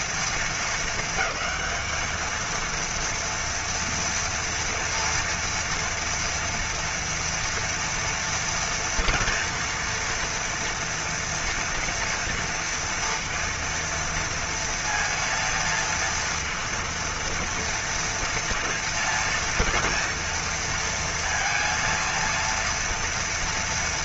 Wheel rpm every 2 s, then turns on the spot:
230, 220, 230, 230, 240, 230, 240, 230, 230, 230, 230, 230.
none